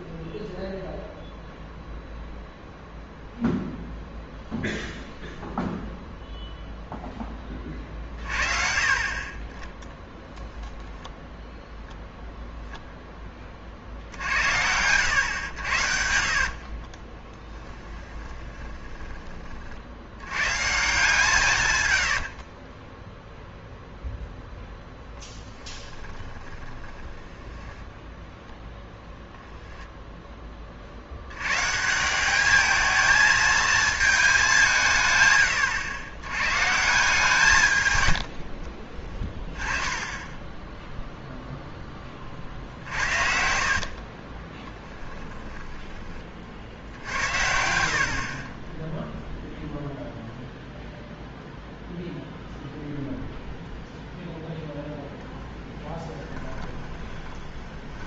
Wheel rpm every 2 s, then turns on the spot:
0, 0, 0, 0, 40, 0, 0, 90, 40, 20, 140, 30, 0, 10, 0, 30, 220, 170, 140, 40, 10, 60, 10, 60, 10, 0, 0, 10, 20.
16-20 22-24 26-28 38-40 42-50 54-58